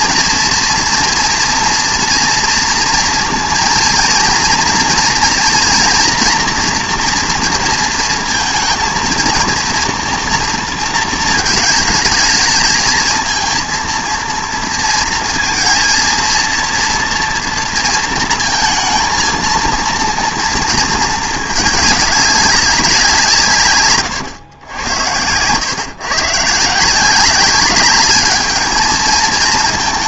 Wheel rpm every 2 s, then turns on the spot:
230, 240, 230, 230, 230, 230, 220, 230, 230, 230, 230, 190, 100, 160, 220.
none